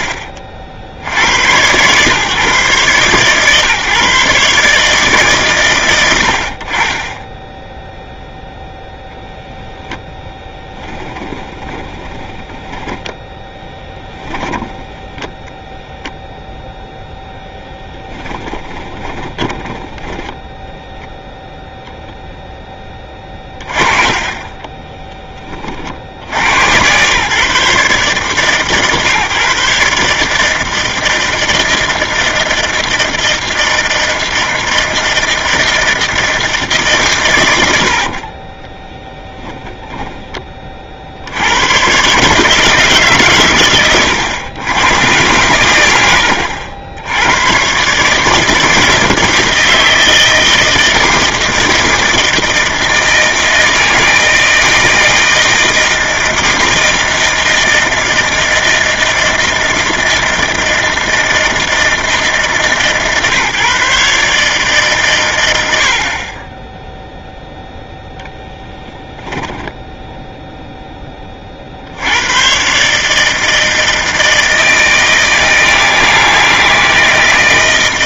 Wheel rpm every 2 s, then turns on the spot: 80, 140, 110, 10, 10, 10, 10, 10, 0, 20, 10, 30, 20, 100, 130, 160, 160, 160, 150, 10, 30, 150, 110, 70, 160, 160, 160, 160, 160, 160, 160, 150, 140, 10, 0, 0, 110, 160, 160.
10-16 18-20 24-26 38-40